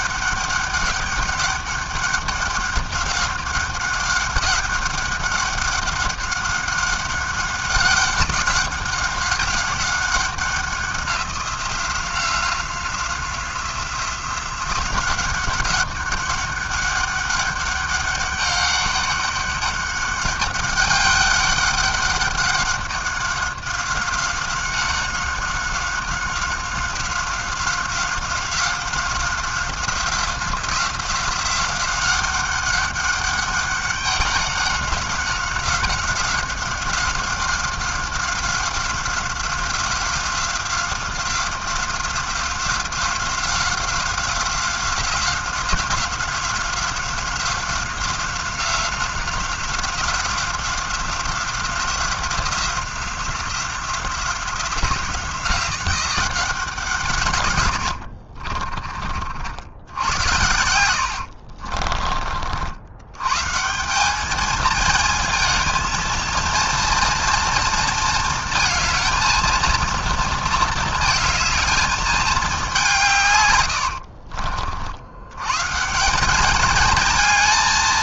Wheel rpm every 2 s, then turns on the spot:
200, 190, 200, 190, 190, 190, 180, 180, 200, 200, 200, 200, 190, 190, 190, 180, 200, 190, 190, 180, 180, 180, 180, 180, 180, 190, 180, 180, 170, 30, 90, 70, 220, 230, 220, 230, 200, 60, 210.
58-62